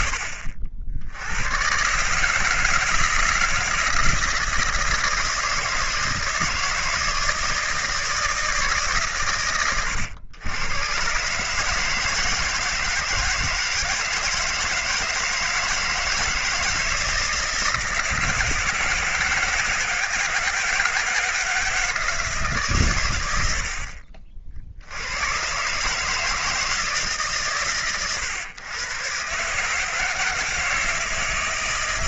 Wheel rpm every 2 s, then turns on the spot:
70, 160, 170, 160, 130, 120, 160, 160, 160, 160, 160, 110, 90, 150, 130, 160.
none